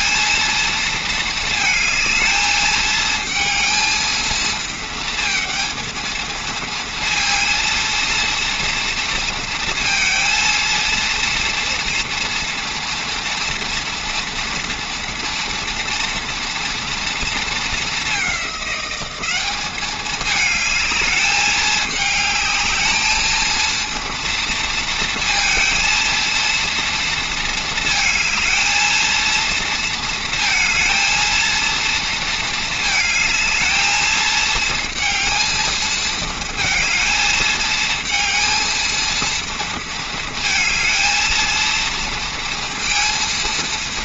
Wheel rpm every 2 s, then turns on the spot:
230, 220, 230, 230, 230, 230, 230, 240, 230, 200, 210, 220, 230, 230, 220, 230, 220, 220, 230, 220, 230, 230.
none